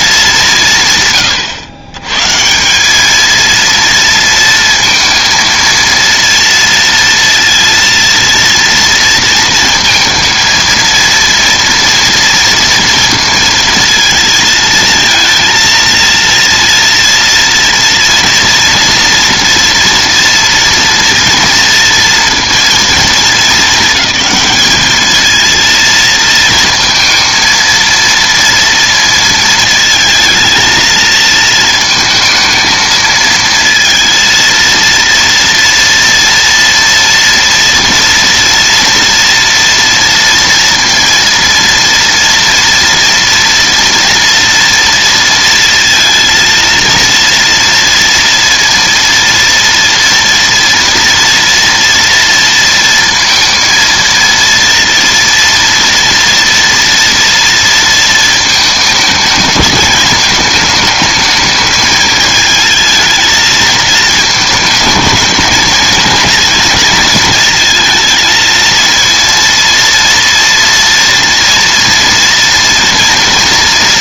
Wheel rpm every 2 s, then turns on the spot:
170, 170, 230, 230, 230, 220, 230, 230, 230, 240, 230, 220, 210, 230, 230, 220, 220, 230, 230, 230, 230, 230, 230, 230, 230, 230, 230, 230, 230, 220, 210, 220, 220, 220, 230, 230, 230.
none